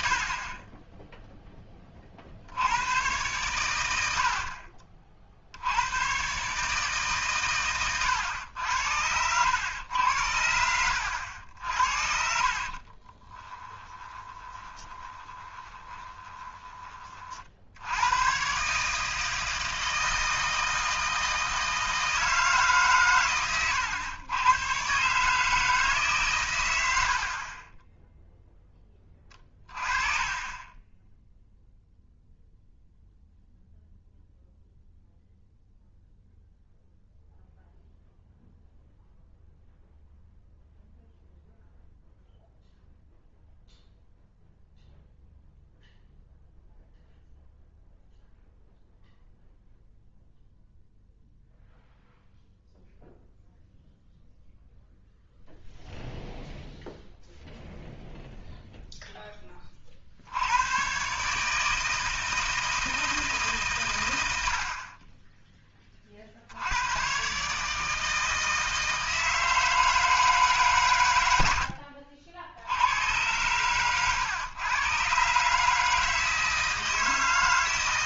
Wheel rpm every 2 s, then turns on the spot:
30, 90, 50, 140, 90, 90, 40, 20, 20, 130, 160, 150, 120, 100, 10, 10, 0, 0, 0, 0, 0, 0, 0, 0, 0, 0, 0, 0, 0, 0, 110, 160, 60, 90, 160, 140, 80, 120, 160.
4-6 10-16